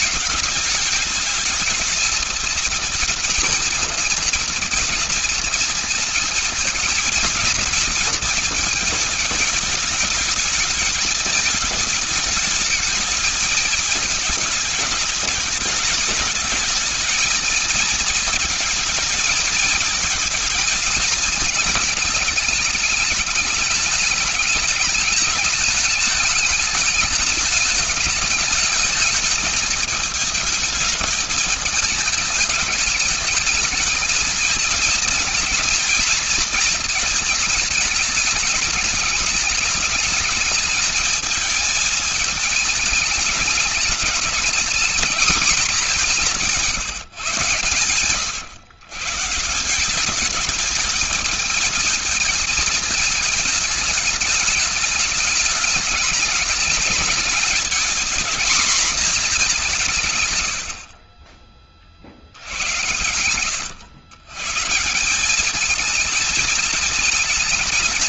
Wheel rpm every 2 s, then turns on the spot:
210, 230, 230, 220, 220, 220, 220, 220, 220, 230, 230, 210, 210, 210, 210, 220, 210, 220, 220, 210, 220, 220, 220, 170, 130, 210, 220, 210, 210, 240, 70, 80, 160, 220.
none